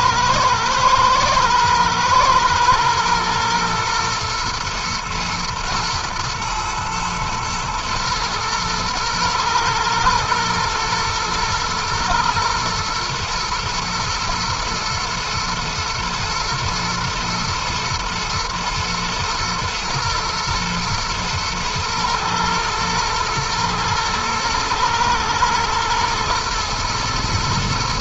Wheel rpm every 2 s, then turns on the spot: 120, 120, 120, 110, 120, 110, 120, 120, 120, 110, 120, 110, 110, 110.
none